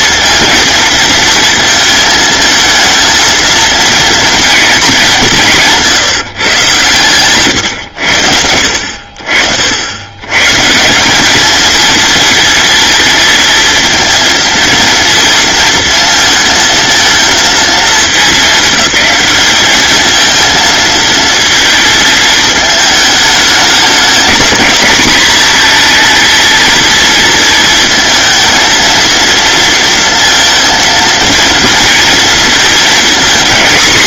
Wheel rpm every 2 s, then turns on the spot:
230, 230, 230, 130, 70, 150, 230, 230, 230, 210, 230, 220, 220, 230, 220, 230, 230.
none